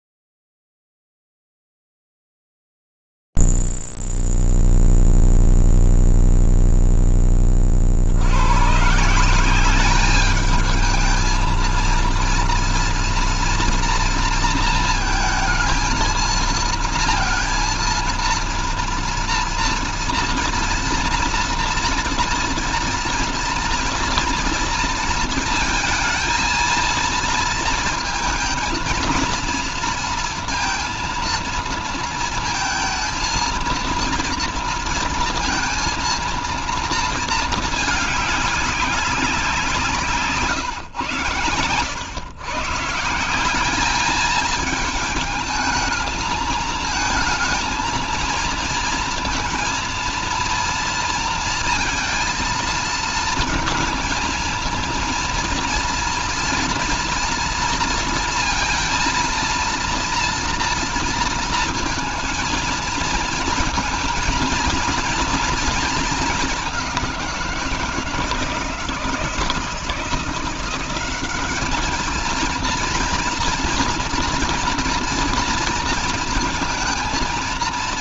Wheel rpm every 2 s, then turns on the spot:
0, 0, 0, 0, 90, 210, 230, 230, 230, 230, 240, 230, 230, 230, 230, 230, 230, 230, 230, 200, 120, 140, 220, 220, 230, 230, 230, 230, 230, 230, 230, 230, 230, 200, 160, 180, 230, 230, 220.
none